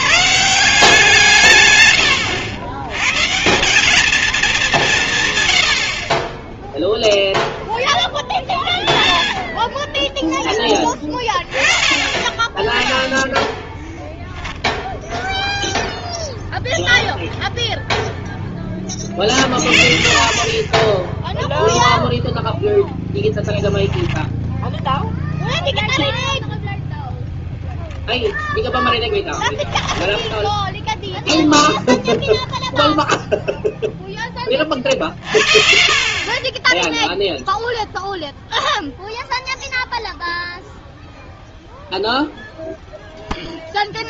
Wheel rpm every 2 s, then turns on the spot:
170, 120, 180, 0, 10, 20, 10, 0, 0, 20, 20, 0, 0, 0, 10, 0, 0, 40, 10, 0, 0, 0.
none